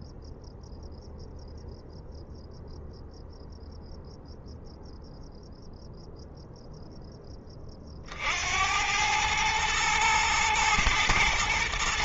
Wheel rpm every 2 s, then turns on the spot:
0, 0, 0, 0, 90, 110.
none